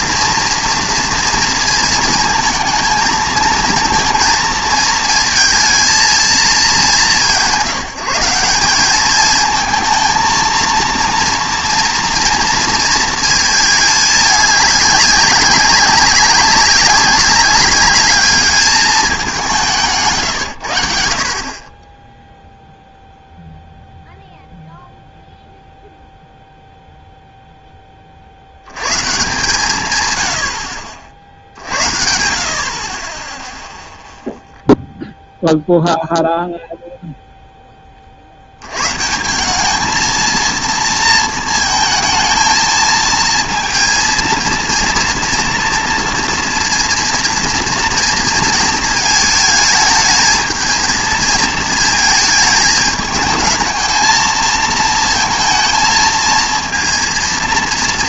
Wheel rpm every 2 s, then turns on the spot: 230, 220, 230, 180, 190, 230, 230, 210, 190, 210, 90, 0, 0, 0, 100, 60, 50, 0, 0, 100, 230, 220, 230, 230, 230, 220, 220, 220, 230.
none